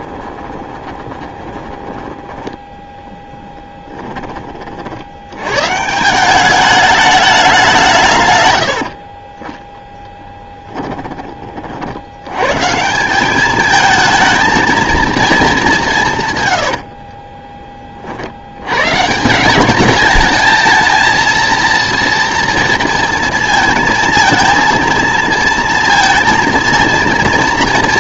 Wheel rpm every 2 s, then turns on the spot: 30, 10, 40, 200, 90, 10, 150, 230, 80, 110, 220, 230, 220, 230.
0-2 10-12 16-18